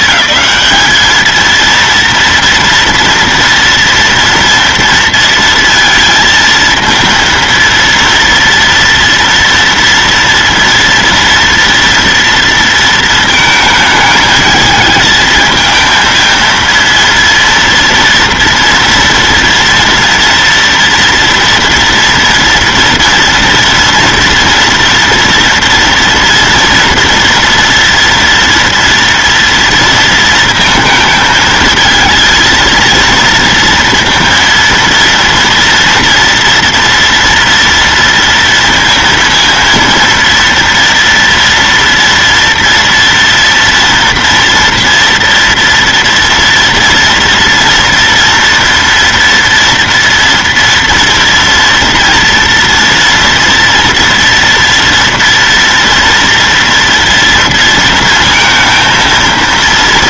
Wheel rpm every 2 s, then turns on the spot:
210, 230, 230, 230, 230, 230, 230, 220, 230, 230, 230, 230, 230, 230, 230, 220, 230, 230, 240, 230, 230, 230, 230, 230, 230, 230, 230, 230, 230, 220.
none